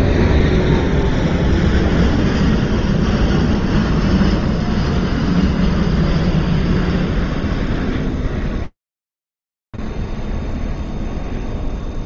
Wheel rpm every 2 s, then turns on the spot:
0, 0, 0, 0, 0, 0.
none